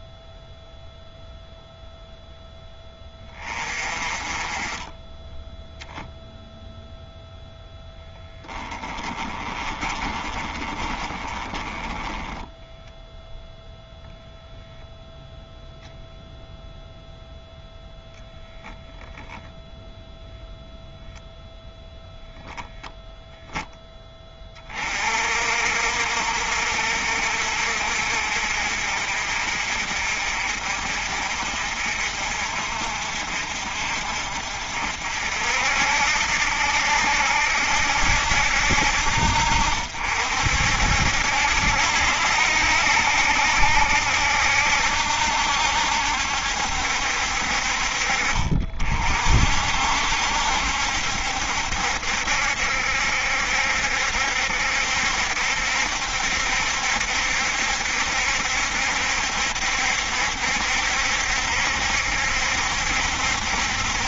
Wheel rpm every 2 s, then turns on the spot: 0, 10, 10, 0, 20, 20, 10, 0, 0, 0, 0, 0, 40, 60, 50, 50, 50, 60, 80, 70, 70, 70, 70, 60, 50, 70, 70, 70, 70, 70, 70, 70.
8-12